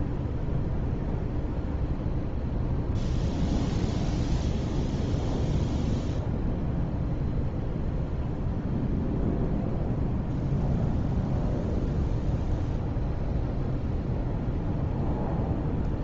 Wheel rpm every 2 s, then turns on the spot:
0, 0, 0, 0, 0, 0, 0, 0.
none